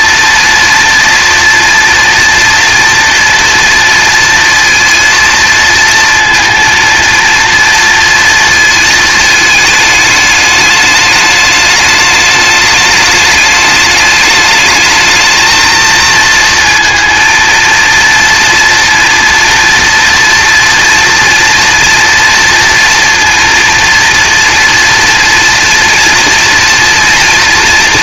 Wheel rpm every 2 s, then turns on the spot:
230, 240, 230, 230, 220, 210, 210, 220, 230, 230, 230, 230, 230, 230.
none